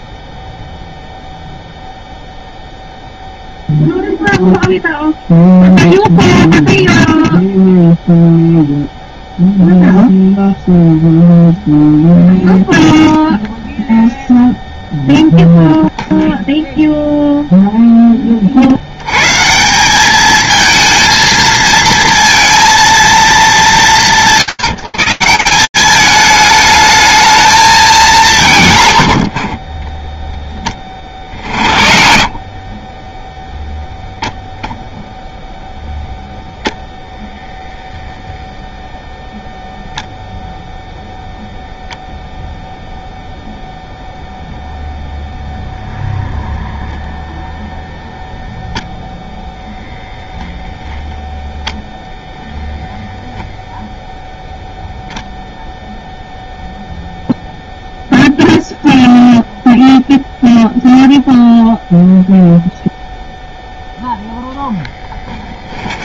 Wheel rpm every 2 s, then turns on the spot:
0, 0, 0, 0, 0, 0, 0, 0, 0, 30, 220, 230, 140, 210, 120, 20, 40, 0, 0, 0, 0, 0, 0, 0, 0, 0, 0, 0, 0, 0, 0, 0, 10.
none